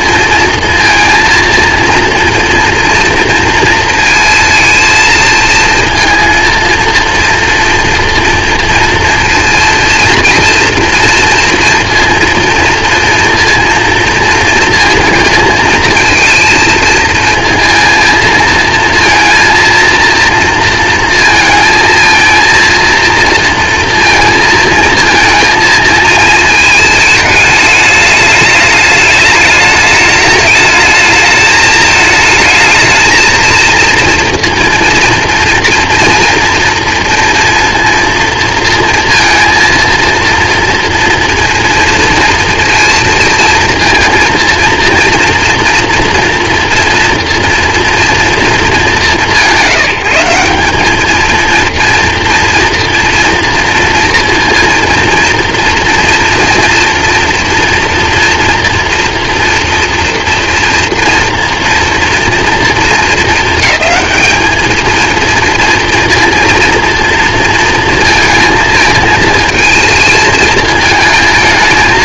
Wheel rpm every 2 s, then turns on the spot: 230, 230, 230, 230, 230, 230, 230, 230, 230, 230, 230, 230, 230, 220, 210, 210, 220, 230, 230, 230, 230, 230, 230, 240, 230, 180, 230, 230, 230, 230, 230, 230, 220, 230, 220, 220.
none